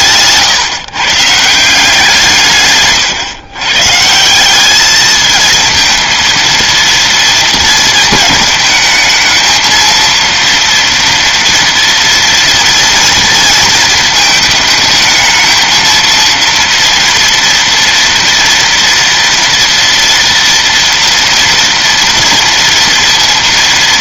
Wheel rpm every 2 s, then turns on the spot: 150, 150, 200, 230, 210, 230, 230, 220, 230, 230, 230, 230.
none